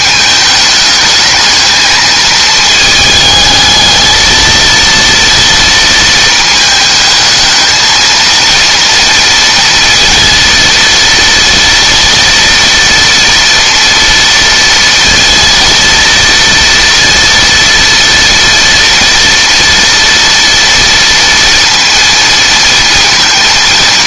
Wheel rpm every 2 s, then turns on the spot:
210, 220, 230, 220, 230, 230, 230, 230, 230, 230, 230, 230.
none